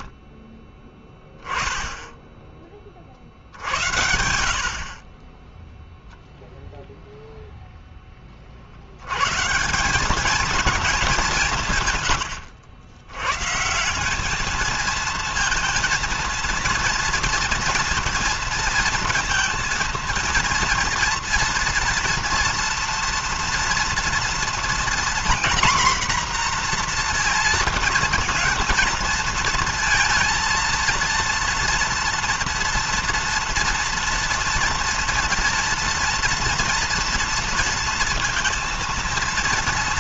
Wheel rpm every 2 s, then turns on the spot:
10, 40, 40, 0, 70, 210, 90, 220, 230, 230, 230, 230, 240, 240, 230, 230, 230, 230, 230, 230.
none